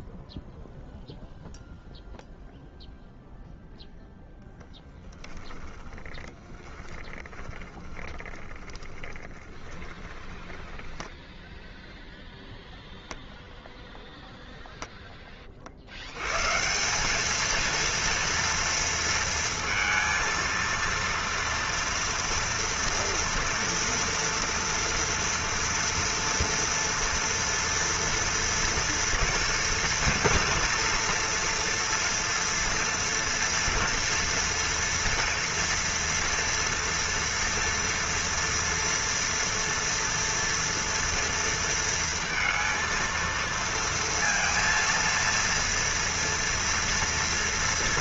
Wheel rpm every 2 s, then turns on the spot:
0, 0, 0, 20, 20, 20, 0, 10, 190, 230, 230, 230, 230, 230, 230, 240, 230, 240, 230, 240, 230, 230, 230, 240.
6-12